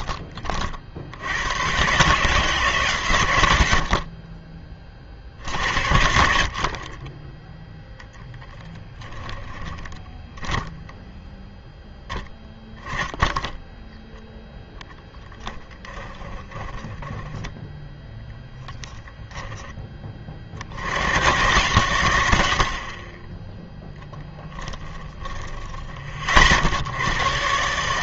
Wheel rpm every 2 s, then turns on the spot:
40, 150, 30, 50, 10, 10, 10, 0, 10, 10, 60, 70, 10, 80.
8-10 16-18 24-26